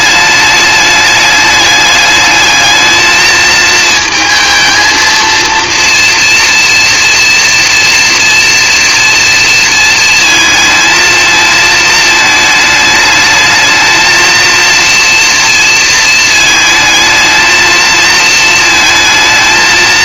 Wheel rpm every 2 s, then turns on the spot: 210, 220, 230, 230, 230, 220, 220, 230, 220, 230.
none